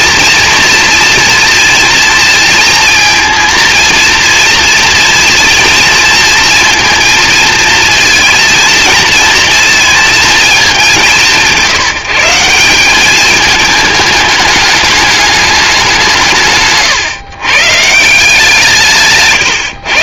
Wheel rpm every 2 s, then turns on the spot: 230, 230, 230, 230, 220, 200, 190, 210, 140, 160.
16-18